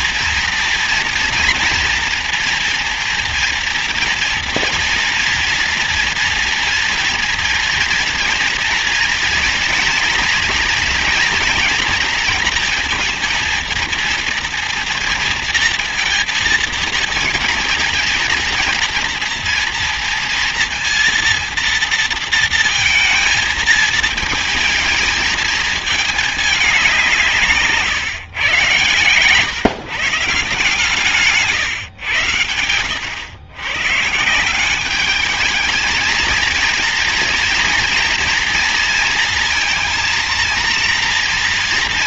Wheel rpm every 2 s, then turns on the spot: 240, 230, 240, 240, 230, 230, 230, 230, 230, 230, 230, 230, 220, 200, 130, 150, 110, 180, 230, 230, 230.
none